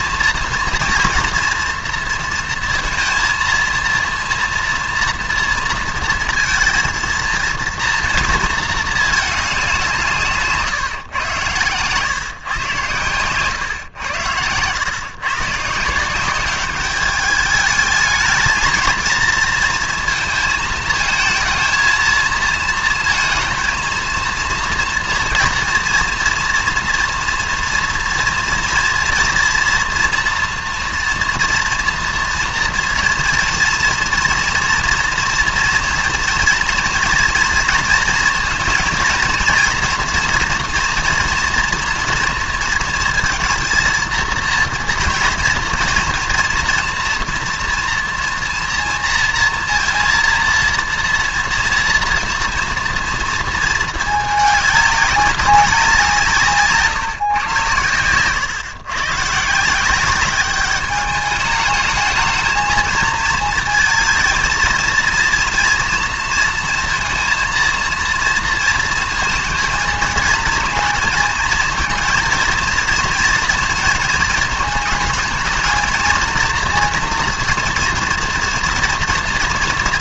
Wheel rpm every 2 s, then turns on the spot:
230, 230, 230, 220, 220, 150, 120, 110, 200, 220, 220, 230, 230, 230, 230, 230, 230, 230, 230, 230, 240, 230, 230, 230, 230, 230, 230, 210, 150, 120, 200, 220, 230, 230, 230, 230, 230, 220, 230, 230.
none